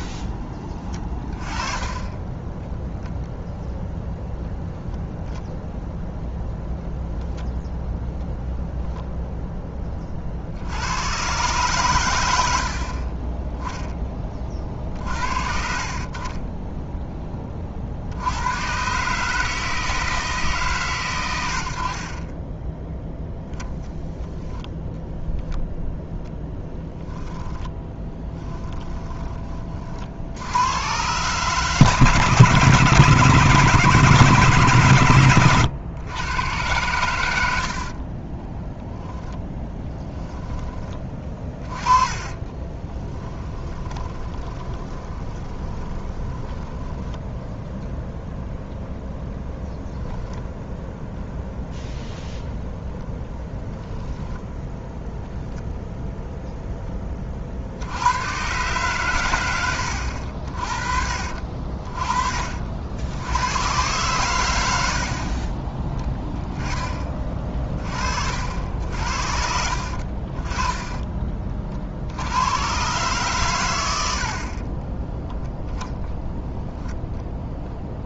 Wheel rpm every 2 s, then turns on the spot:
30, 10, 0, 10, 0, 70, 110, 20, 20, 110, 150, 10, 10, 0, 10, 90, 140, 140, 120, 20, 10, 20, 20, 10, 0, 0, 0, 10, 0, 120, 50, 50, 90, 10, 60, 30, 100, 40, 0.
0-2 16-18 24-26 28-30 38-40 42-48 54-56